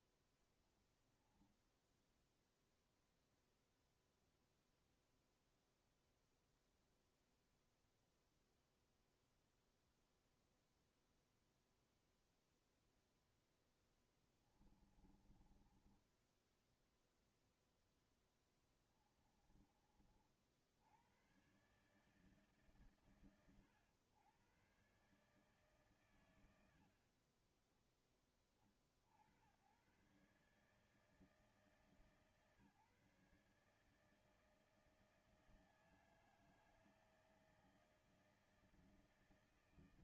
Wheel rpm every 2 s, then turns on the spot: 0, 0, 0, 0, 0, 0, 0, 20, 10, 0, 60, 150, 110, 110, 30, 130, 150, 160, 160, 160.
14-18